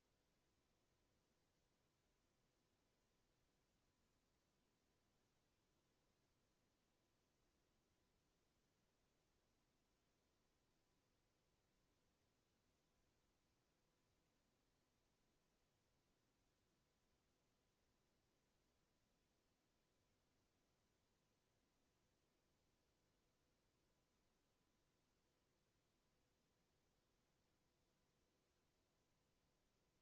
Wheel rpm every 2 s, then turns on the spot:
0, 0, 0, 0, 0, 0, 0, 0, 0, 0, 0, 0, 0, 0, 0.
none